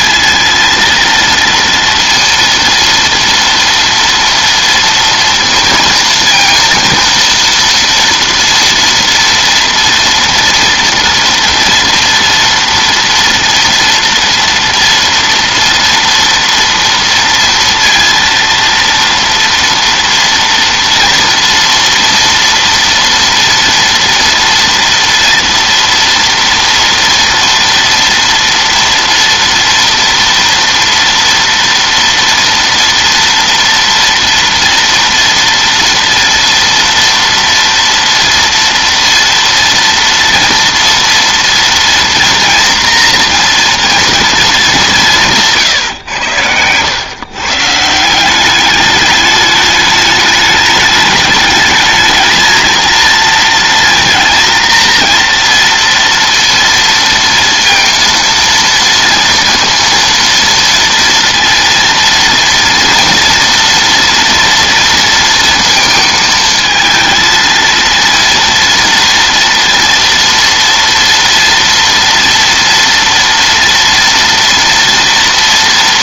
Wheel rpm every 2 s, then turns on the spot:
230, 230, 230, 230, 230, 230, 230, 230, 230, 230, 230, 240, 230, 230, 230, 230, 230, 230, 230, 230, 230, 230, 210, 110, 200, 210, 230, 230, 230, 230, 230, 230, 230, 220, 230, 230, 230, 230.
none